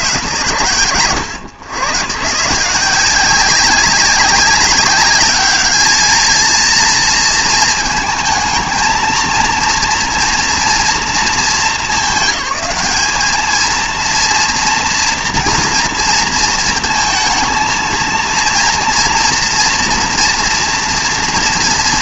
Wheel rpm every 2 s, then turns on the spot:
60, 150, 200, 230, 230, 230, 210, 230, 230, 230, 230.
none